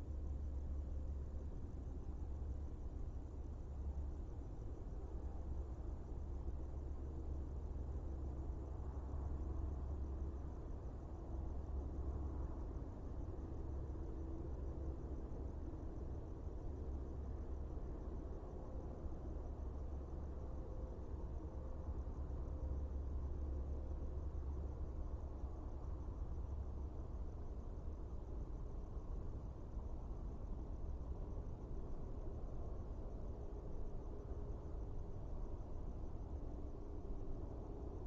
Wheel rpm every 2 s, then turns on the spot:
0, 0, 0, 0, 0, 0, 0, 0, 0, 0, 0, 0, 0, 0, 0, 0, 0, 0, 0.
none